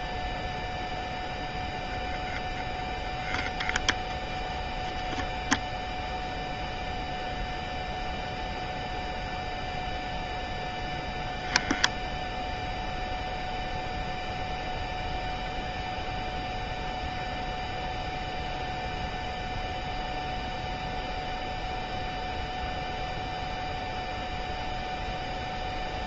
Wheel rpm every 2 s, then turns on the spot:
0, 0, 0, 0, 0, 0, 0, 0, 0, 0, 0, 0, 0.
none